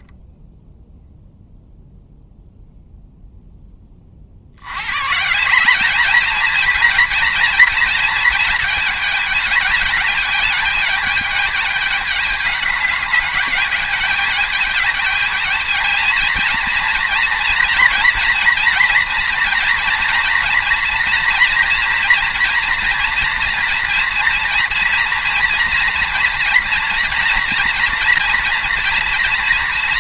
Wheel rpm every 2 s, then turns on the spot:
10, 0, 100, 230, 220, 210, 210, 210, 230, 230, 230, 230, 230, 230, 240.
none